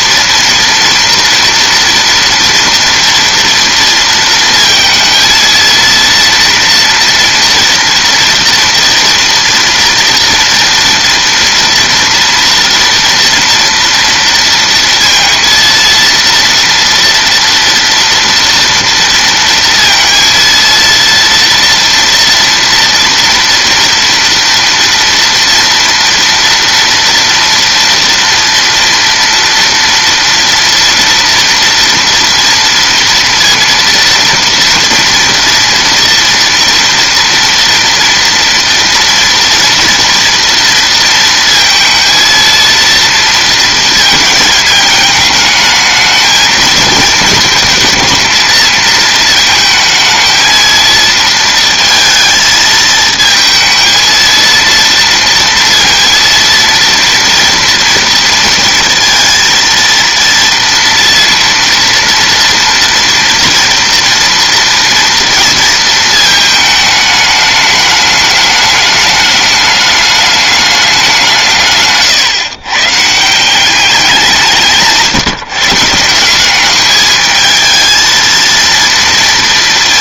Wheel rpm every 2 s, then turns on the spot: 230, 230, 230, 230, 230, 230, 230, 230, 230, 230, 230, 230, 230, 230, 230, 230, 230, 230, 230, 240, 230, 230, 220, 220, 220, 230, 220, 230, 230, 230, 230, 230, 230, 210, 210, 200, 150, 150, 210, 230.
none